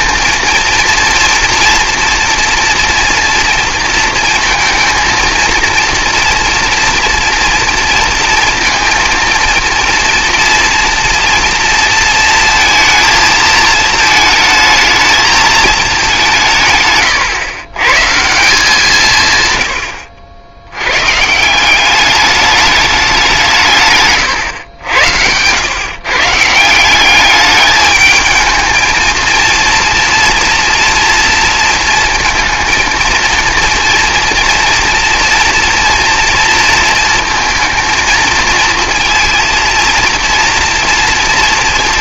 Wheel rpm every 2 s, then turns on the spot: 230, 230, 230, 230, 230, 230, 220, 220, 160, 190, 90, 210, 100, 170, 220, 230, 230, 240, 230, 230, 230.
none